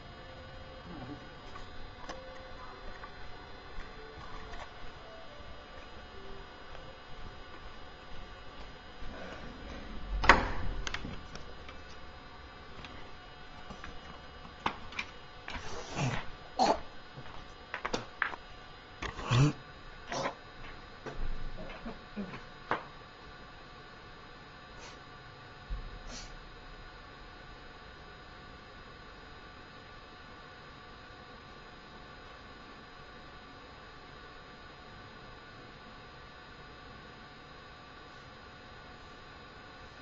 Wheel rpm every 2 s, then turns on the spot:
0, 0, 0, 0, 0, 0, 0, 0, 0, 0, 0, 0, 0, 0, 0, 0, 0, 0, 0, 0.
none